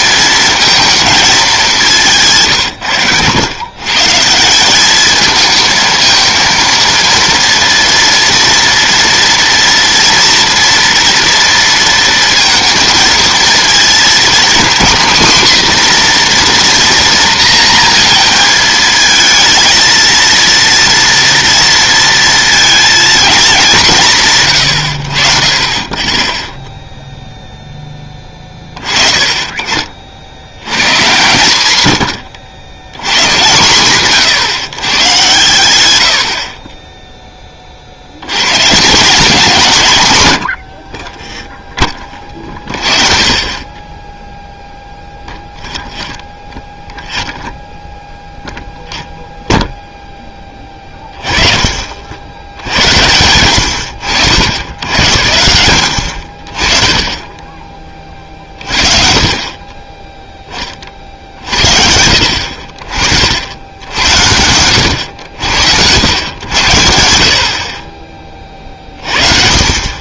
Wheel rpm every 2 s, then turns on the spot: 230, 120, 190, 230, 230, 230, 220, 250, 240, 220, 230, 230, 100, 0, 30, 110, 100, 140, 30, 150, 70, 30, 0, 0, 0, 20, 90, 90, 30, 40, 30, 50, 90, 90, 30.
none